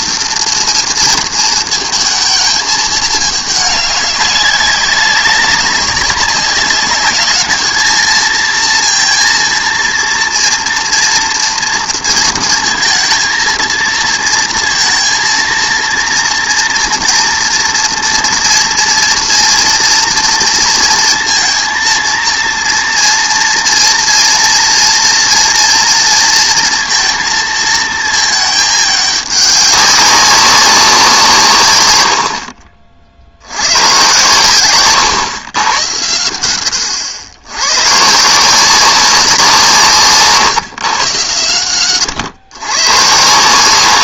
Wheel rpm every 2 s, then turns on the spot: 230, 220, 190, 200, 230, 230, 230, 230, 230, 230, 230, 230, 240, 230, 210, 190, 50, 120, 100, 180, 140, 120.
none